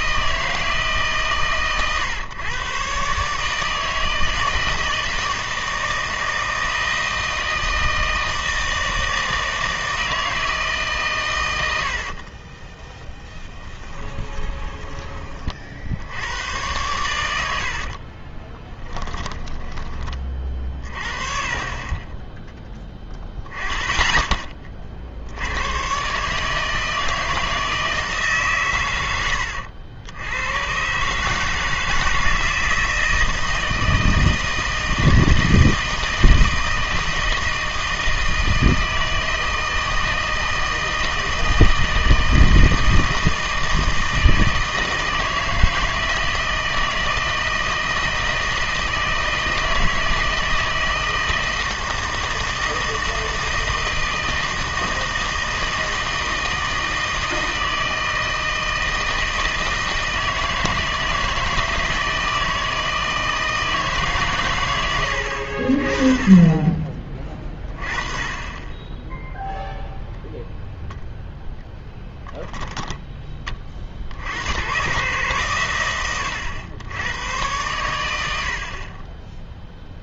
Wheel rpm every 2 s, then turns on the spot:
160, 130, 160, 160, 160, 150, 20, 20, 110, 20, 30, 10, 40, 150, 120, 120, 160, 160, 160, 160, 160, 160, 160, 160, 160, 160, 160, 160, 160, 160, 160, 160, 100, 30, 10, 0, 10, 110, 90, 50.
12-16 18-20